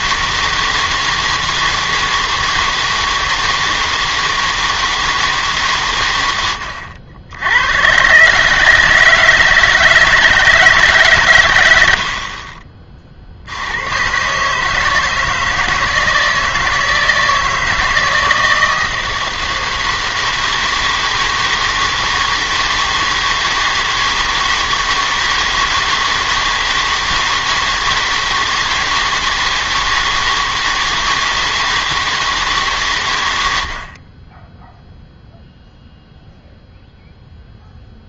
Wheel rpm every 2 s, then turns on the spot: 160, 160, 160, 90, 150, 150, 40, 140, 160, 160, 160, 160, 160, 160, 160, 160, 150, 10, 0.
none